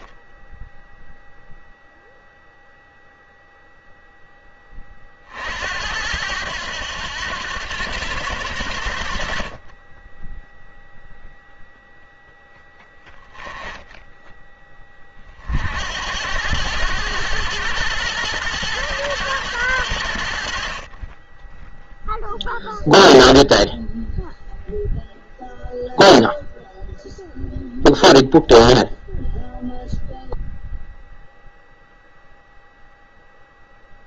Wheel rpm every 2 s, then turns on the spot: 10, 0, 20, 90, 90, 0, 0, 20, 90, 110, 40, 0, 0, 0, 0, 0, 0.
none